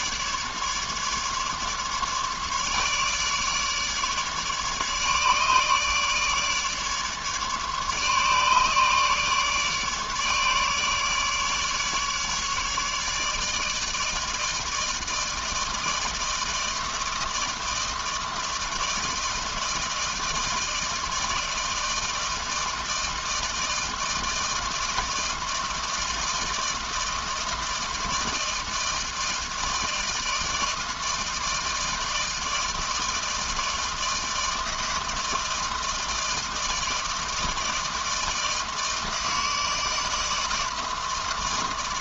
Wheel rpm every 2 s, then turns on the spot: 150, 150, 150, 150, 150, 150, 150, 160, 160, 160, 160, 160, 160, 160, 160, 160, 160, 160, 160, 160, 160.
none